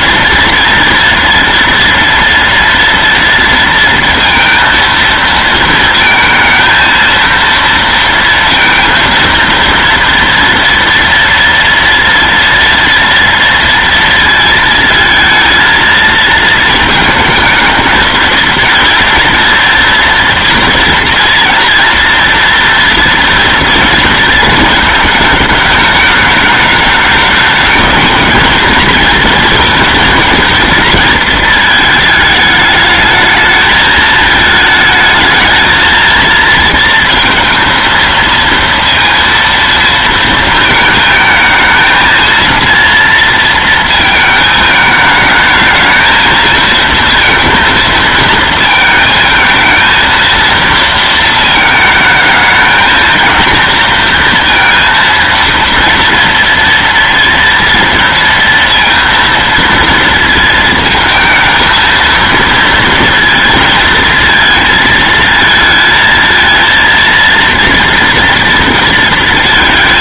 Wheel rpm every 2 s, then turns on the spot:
230, 230, 230, 230, 230, 230, 230, 230, 230, 230, 240, 230, 220, 210, 220, 230, 220, 220, 230, 230, 220, 230, 220, 230, 230, 230, 220, 230, 230, 230, 230, 230, 230, 230, 230.
none